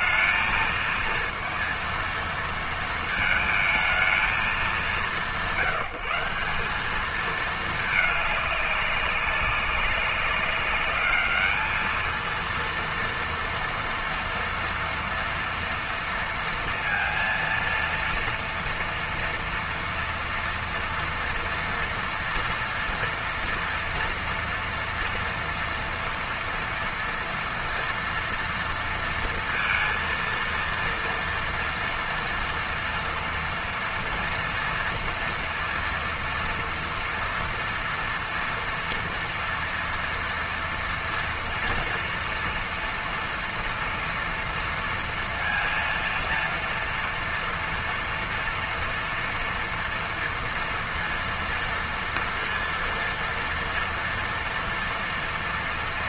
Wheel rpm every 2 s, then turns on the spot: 230, 230, 180, 190, 200, 210, 230, 230, 230, 240, 230, 230, 230, 240, 230, 230, 230, 230, 230, 230, 230, 230, 230, 240, 230, 230, 230, 230.
none